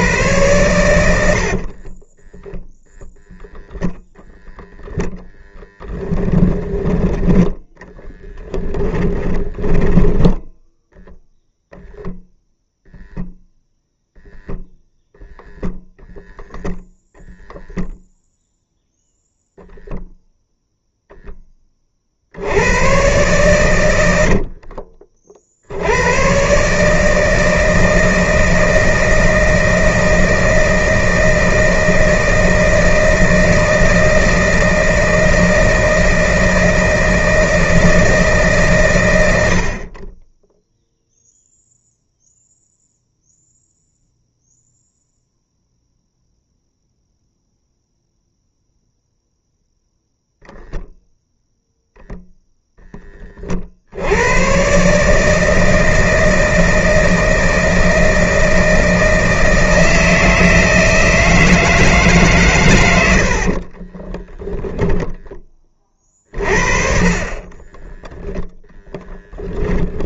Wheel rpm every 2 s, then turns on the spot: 100, 10, 0, 20, 10, 0, 0, 0, 0, 0, 0, 100, 50, 140, 160, 160, 160, 160, 160, 130, 0, 0, 0, 0, 0, 0, 0, 130, 160, 160, 160, 120, 0, 40, 0.
2-4 8-10 24-26